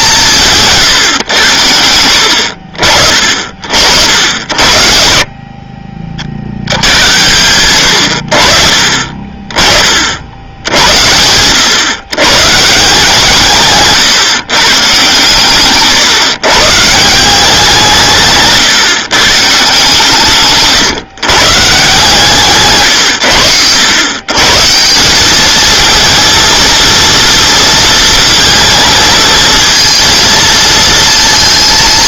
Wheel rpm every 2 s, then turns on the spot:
150, 60, 70, 80, 50, 80, 140, 140, 140, 150, 140, 140, 160, 230, 220, 230.
none